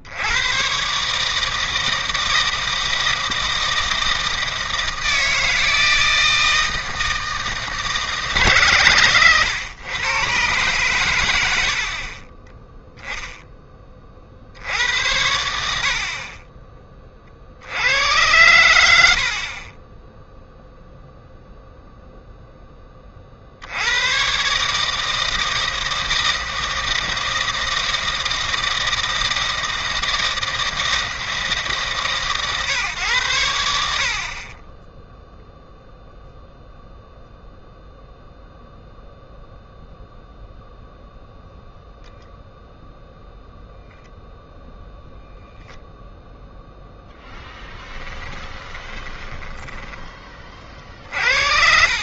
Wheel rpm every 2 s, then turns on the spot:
120, 160, 160, 160, 130, 120, 10, 80, 20, 90, 0, 10, 140, 160, 160, 160, 130, 20, 0, 0, 0, 0, 0, 0, 20, 40.
48-50